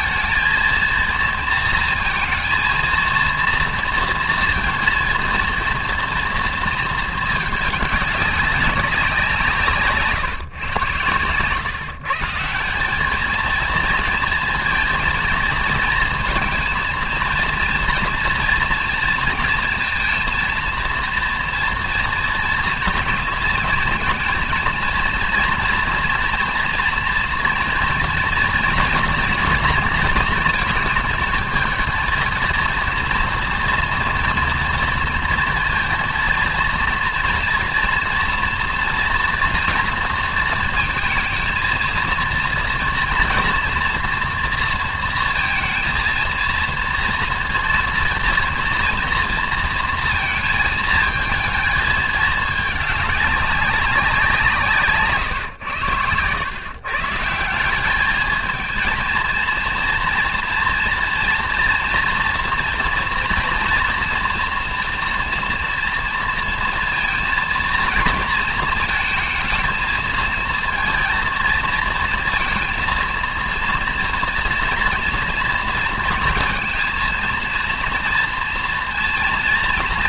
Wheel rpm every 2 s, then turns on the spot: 220, 230, 230, 230, 190, 120, 180, 230, 230, 230, 230, 230, 230, 230, 240, 220, 240, 230, 230, 230, 230, 230, 230, 230, 230, 220, 210, 150, 130, 230, 240, 230, 230, 230, 230, 230, 230, 230, 230, 230.
none